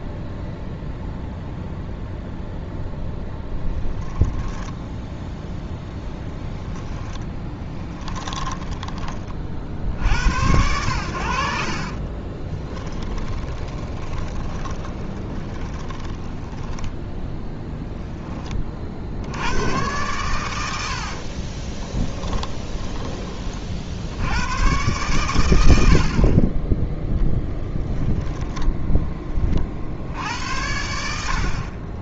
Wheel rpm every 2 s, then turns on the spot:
0, 0, 0, 10, 20, 90, 10, 20, 10, 60, 60, 20, 120, 10, 10, 80.
6-10 12-16 20-22 26-28